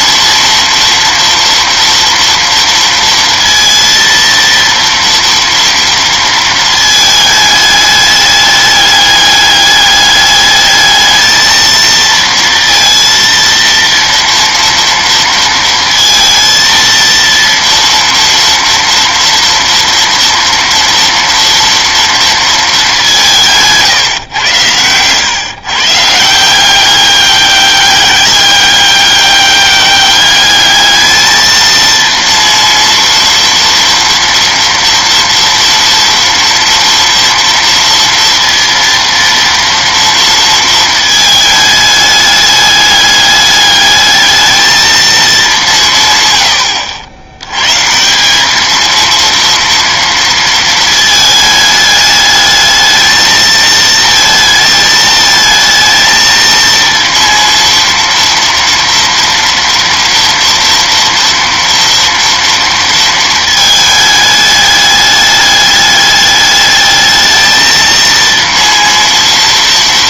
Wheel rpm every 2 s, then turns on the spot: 230, 230, 230, 220, 210, 220, 230, 230, 230, 240, 230, 200, 100, 190, 200, 210, 230, 230, 230, 230, 220, 210, 220, 70, 220, 230, 220, 220, 230, 230, 230, 230, 210, 210, 230.
none